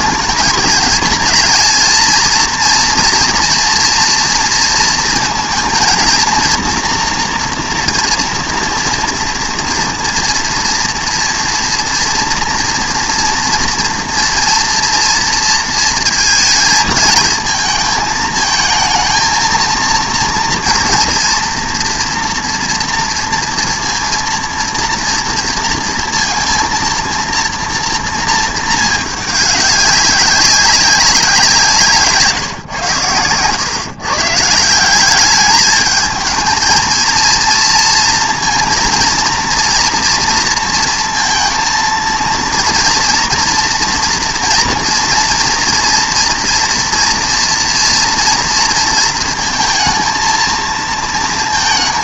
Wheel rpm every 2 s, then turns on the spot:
220, 230, 230, 230, 230, 240, 240, 230, 220, 220, 240, 240, 230, 230, 220, 190, 120, 170, 220, 230, 230, 230, 230, 240, 230, 230.
none